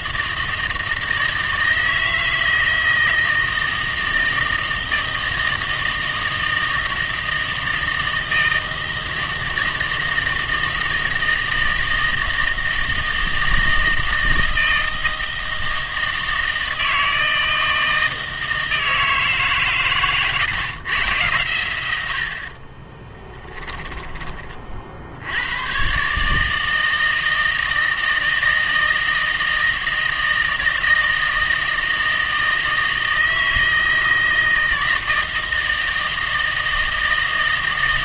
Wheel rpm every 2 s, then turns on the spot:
160, 160, 160, 160, 160, 160, 160, 160, 160, 160, 130, 40, 40, 160, 160, 160, 160, 160, 160.
22-24